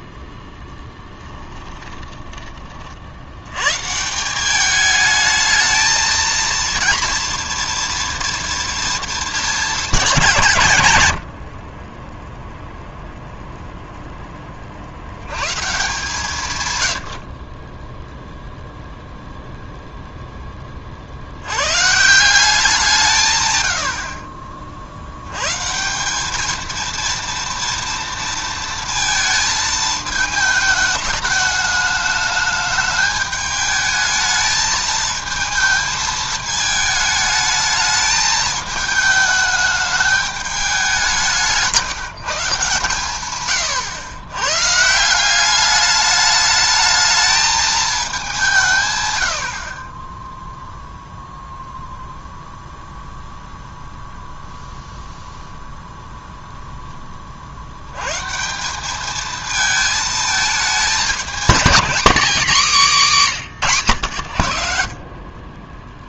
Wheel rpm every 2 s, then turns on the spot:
10, 30, 210, 230, 230, 130, 0, 40, 120, 0, 30, 180, 60, 230, 230, 220, 210, 220, 220, 220, 200, 130, 140, 210, 140, 0, 0, 0, 10, 190, 220, 230, 70.
0-2